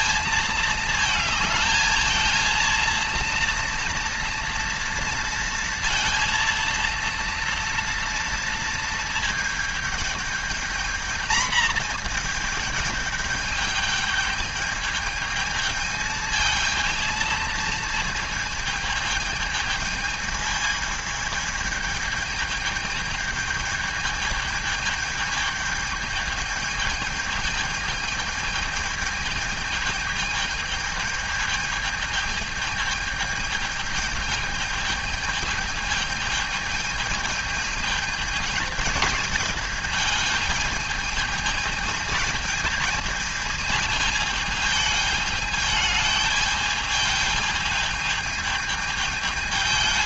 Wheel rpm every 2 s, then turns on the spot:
220, 220, 230, 230, 230, 210, 220, 210, 220, 220, 220, 220, 210, 220, 220, 220, 220, 220, 210, 210, 210, 220, 210, 210, 220.
none